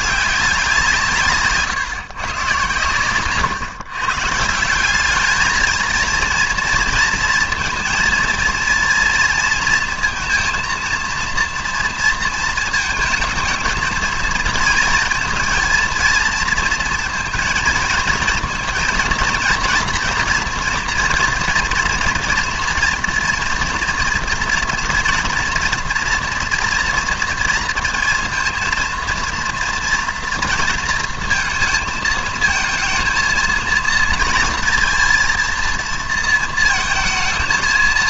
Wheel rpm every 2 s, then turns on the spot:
180, 120, 180, 230, 230, 230, 230, 230, 230, 230, 240, 230, 230, 230, 230, 230, 230, 230, 230.
none